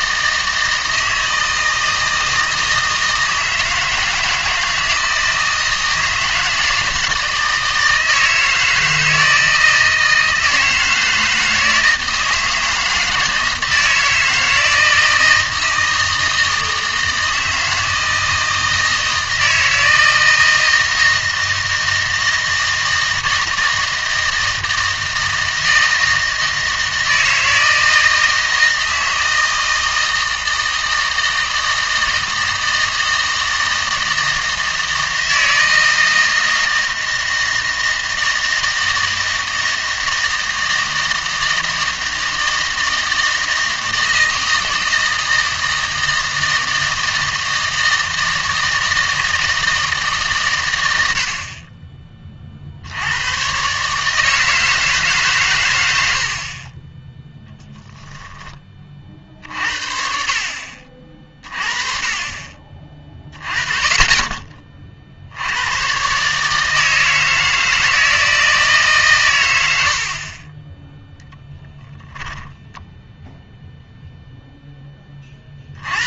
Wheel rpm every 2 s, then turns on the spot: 160, 160, 160, 160, 160, 160, 160, 160, 160, 160, 160, 160, 160, 160, 160, 160, 160, 160, 160, 160, 160, 160, 160, 160, 160, 120, 50, 150, 40, 30, 40, 30, 30, 150, 160, 20, 10, 0.
72-74